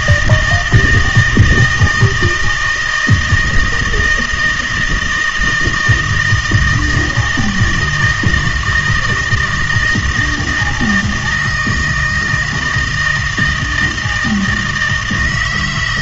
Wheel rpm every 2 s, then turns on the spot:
160, 170, 160, 160, 160, 160, 160, 160.
none